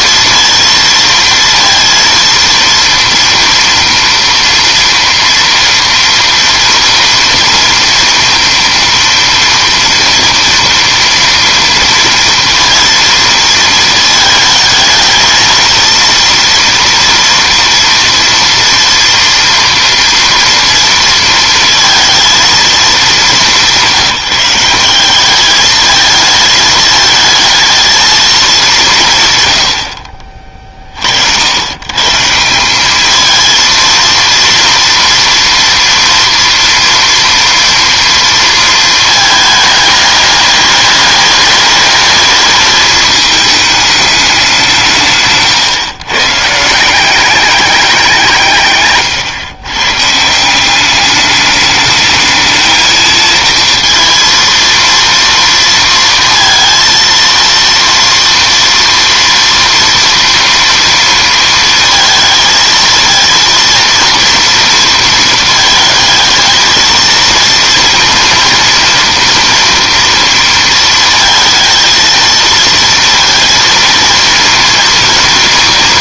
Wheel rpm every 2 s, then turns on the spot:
230, 230, 230, 230, 240, 240, 230, 220, 230, 230, 230, 220, 190, 220, 190, 40, 190, 230, 230, 230, 210, 220, 180, 160, 150, 180, 220, 230, 230, 230, 230, 230, 230, 220, 240, 230, 230, 230.
none